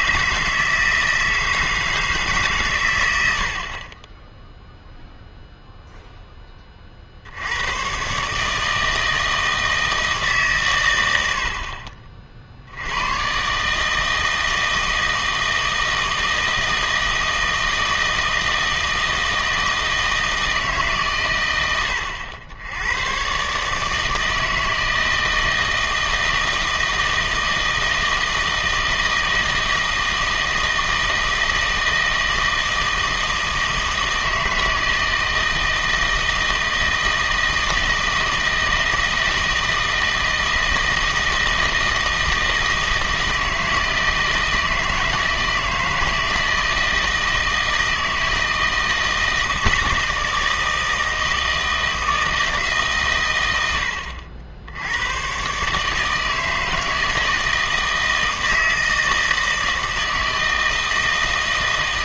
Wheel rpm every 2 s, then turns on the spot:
160, 130, 0, 20, 150, 130, 60, 160, 160, 160, 150, 90, 160, 160, 160, 160, 160, 160, 160, 160, 160, 160, 160, 160, 160, 160, 160, 80, 160, 160, 160.
none